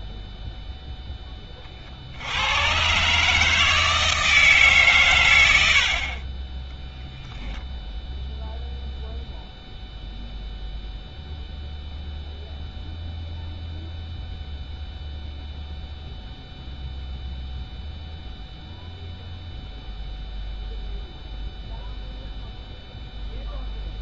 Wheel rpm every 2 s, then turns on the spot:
10, 130, 130, 0, 0, 0, 0, 0, 0, 0, 0, 0.
none